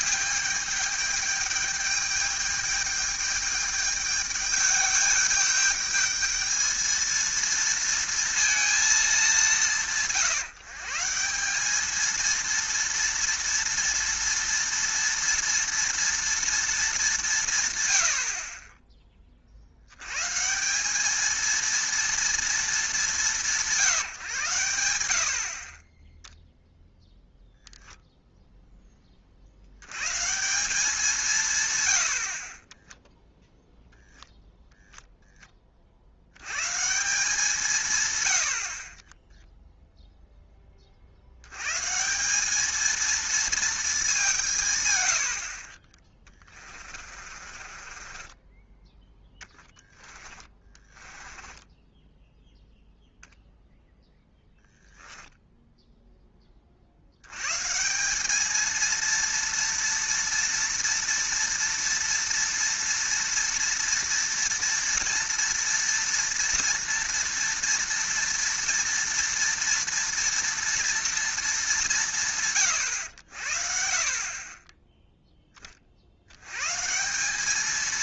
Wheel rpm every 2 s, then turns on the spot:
210, 210, 210, 220, 230, 150, 230, 230, 220, 20, 180, 220, 110, 0, 10, 170, 10, 0, 140, 50, 30, 220, 130, 30, 10, 20, 0, 0, 50, 220, 230, 230, 230, 230, 230, 230, 120, 10, 130.
32-34 46-52